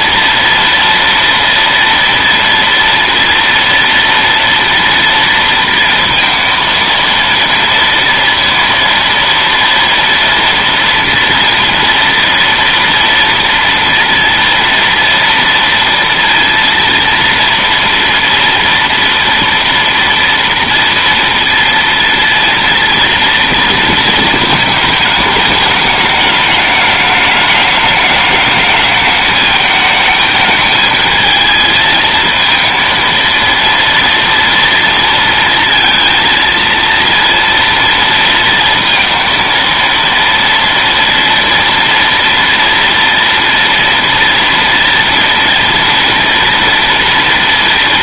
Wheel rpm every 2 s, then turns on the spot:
230, 240, 230, 230, 230, 240, 240, 230, 230, 230, 230, 230, 220, 210, 210, 220, 230, 230, 230, 230, 230, 230, 230, 230.
none